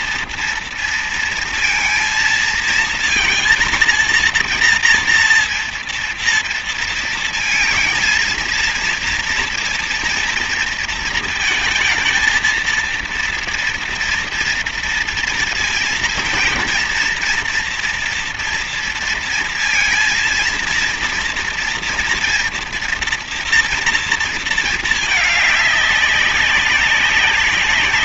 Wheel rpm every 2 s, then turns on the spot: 230, 230, 230, 230, 230, 230, 240, 230, 230, 230, 230, 230, 220, 200.
none